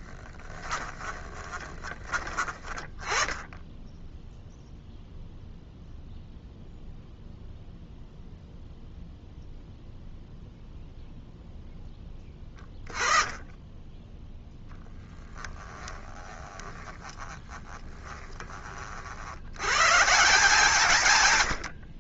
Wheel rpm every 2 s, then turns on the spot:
20, 30, 0, 0, 0, 0, 10, 10, 20, 50, 130.
0-2 14-18